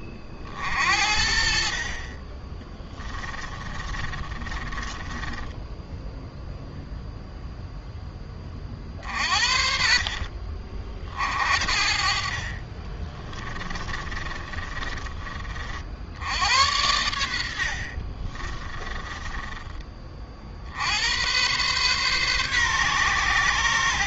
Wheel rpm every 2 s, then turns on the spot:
50, 20, 20, 0, 40, 50, 40, 30, 90, 20, 80, 130.
2-6 12-16 18-20